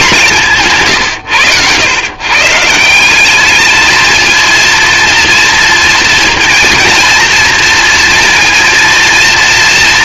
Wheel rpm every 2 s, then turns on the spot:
140, 170, 220, 230, 230.
0-2